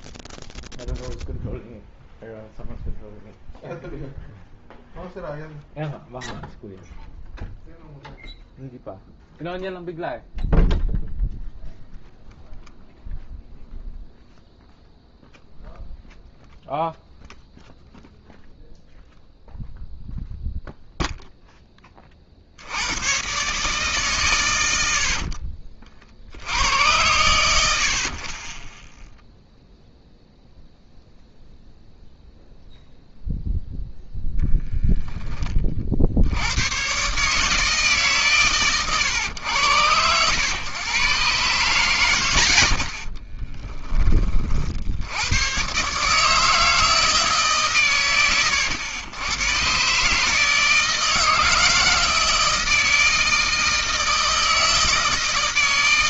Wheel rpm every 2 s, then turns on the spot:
0, 0, 0, 0, 0, 0, 0, 0, 0, 0, 0, 50, 120, 60, 30, 0, 0, 0, 80, 140, 100, 90, 30, 150, 110, 150, 160, 160.
none